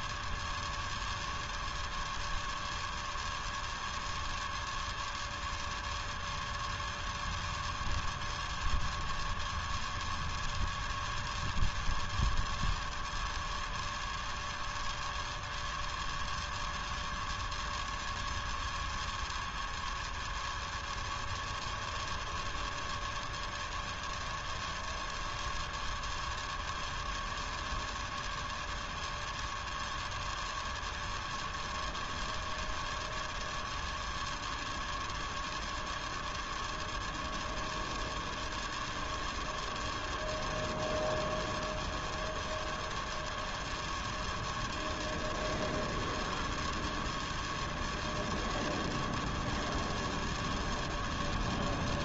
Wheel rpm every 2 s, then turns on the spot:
0, 0, 0, 0, 0, 0, 0, 0, 0, 0, 0, 0, 0, 0, 0, 0, 0, 0, 0, 0, 0, 0, 0, 0, 0, 0.
none